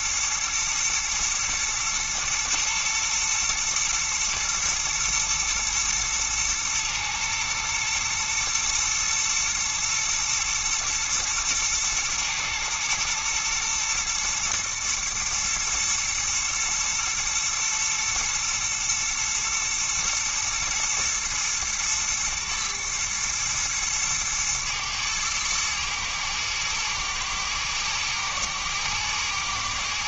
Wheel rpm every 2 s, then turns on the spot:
120, 120, 120, 110, 110, 120, 120, 110, 120, 120, 120, 110, 110, 120, 110.
none